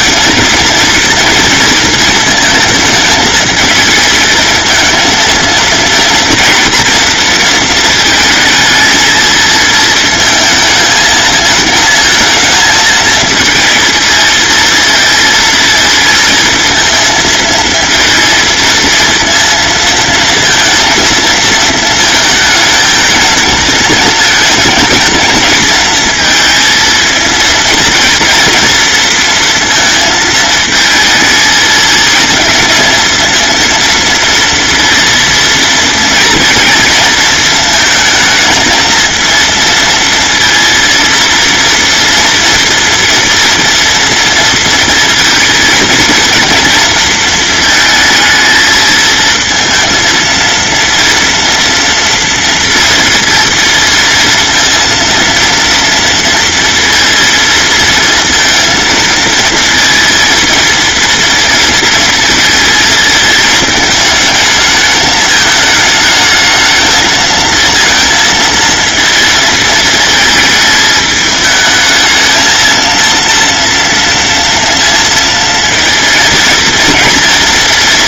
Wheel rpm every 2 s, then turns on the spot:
230, 220, 220, 230, 220, 220, 220, 230, 230, 230, 230, 220, 230, 230, 230, 220, 220, 230, 230, 220, 230, 230, 230, 230, 220, 230, 230, 230, 230, 220, 230, 220, 220, 220, 230, 220, 230, 230, 230.
none